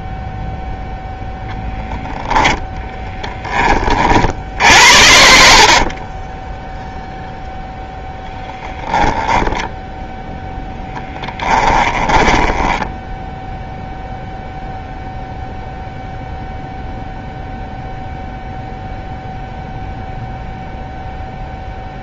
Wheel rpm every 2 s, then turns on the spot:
0, 10, 70, 10, 10, 10, 10, 0, 0, 0, 0.
12-14